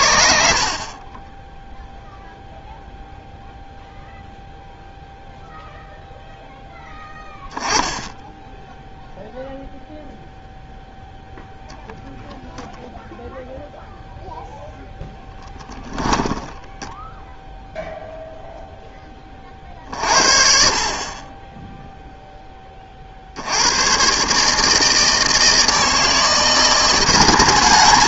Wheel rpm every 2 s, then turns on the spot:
0, 0, 0, 10, 0, 10, 0, 10, 0, 40, 0, 120, 160, 210.
14-16